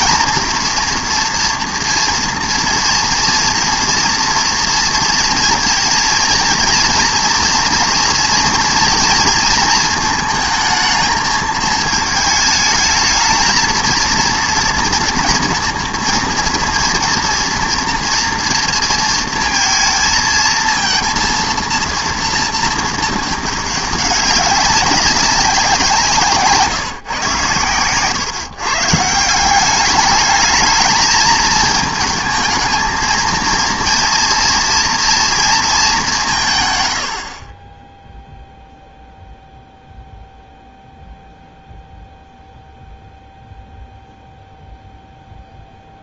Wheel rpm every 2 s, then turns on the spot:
230, 230, 230, 230, 240, 220, 220, 230, 230, 230, 220, 230, 200, 150, 130, 220, 220, 230, 130, 0, 0, 0, 0.
none